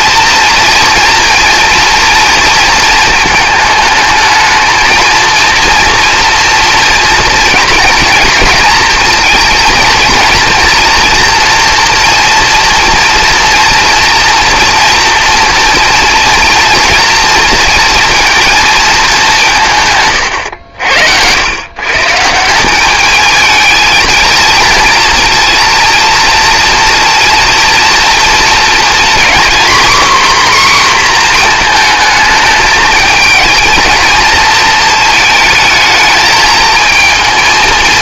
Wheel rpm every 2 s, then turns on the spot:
230, 220, 220, 230, 230, 230, 230, 240, 230, 230, 90, 180, 230, 230, 230, 260, 220, 230, 220.
none